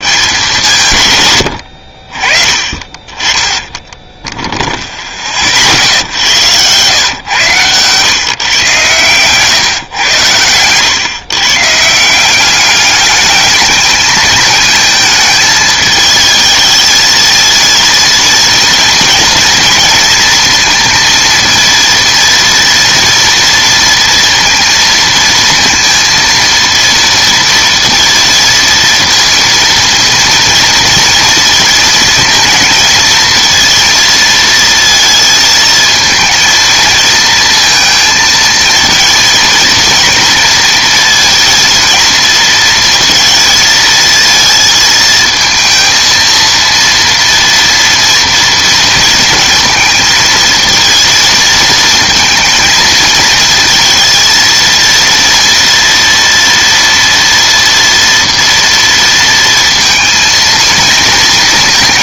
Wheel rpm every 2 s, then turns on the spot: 140, 30, 40, 120, 120, 110, 210, 220, 220, 230, 230, 230, 230, 230, 230, 230, 220, 230, 230, 220, 230, 230, 220, 230, 220, 220, 220, 230, 230, 230, 230.
none